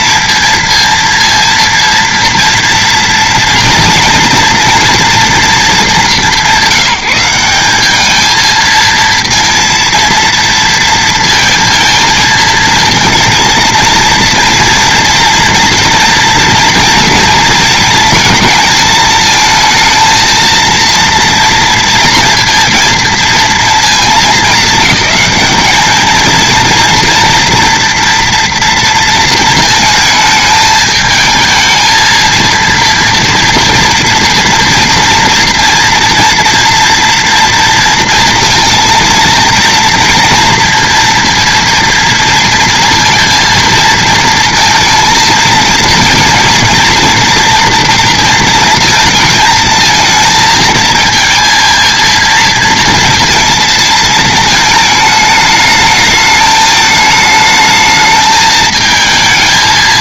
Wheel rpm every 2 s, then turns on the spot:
230, 230, 230, 200, 220, 230, 230, 230, 230, 220, 230, 230, 210, 230, 230, 220, 230, 230, 230, 230, 230, 230, 230, 230, 230, 230, 230, 220, 220, 220.
none